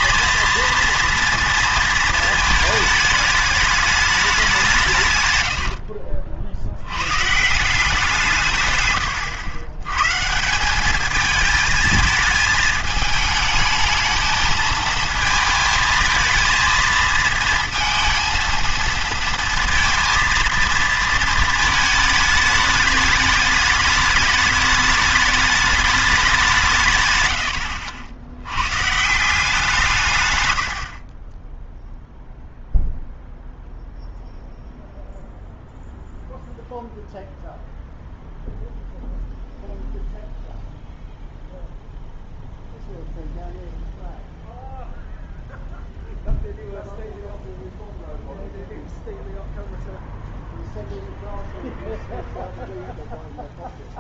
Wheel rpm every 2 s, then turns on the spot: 230, 220, 170, 80, 130, 190, 220, 220, 220, 230, 230, 210, 210, 170, 110, 80, 0, 0, 0, 0, 0, 0, 0, 0, 0, 0, 0.
30-32